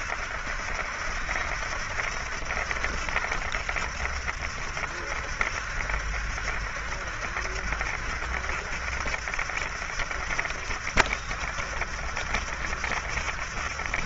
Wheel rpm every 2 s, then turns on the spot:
70, 70, 70, 70, 70, 70, 70.
none